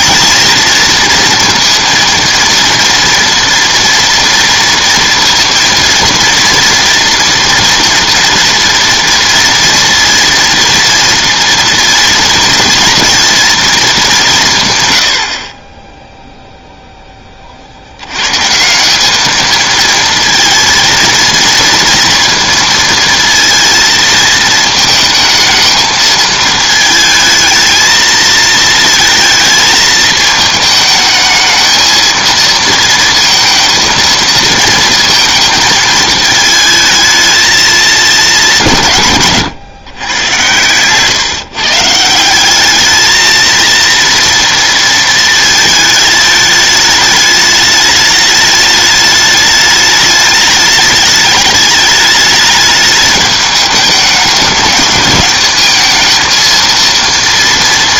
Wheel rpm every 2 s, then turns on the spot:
230, 230, 230, 230, 230, 230, 230, 140, 0, 170, 230, 230, 220, 220, 230, 220, 230, 230, 220, 170, 120, 200, 230, 210, 210, 210, 210, 210, 230.
none